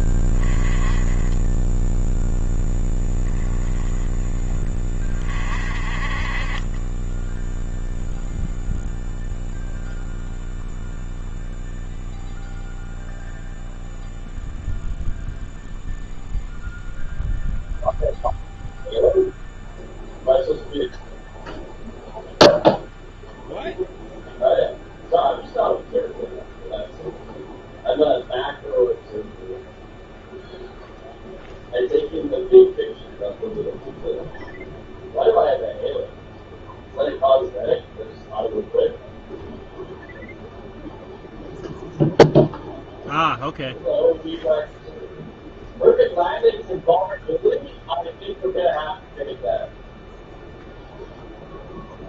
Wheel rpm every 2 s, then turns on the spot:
10, 0, 20, 30, 0, 0, 0, 0, 0, 0, 0, 0, 0, 0, 0, 0, 0, 0, 0, 0, 0, 0, 0, 0, 0, 0.
none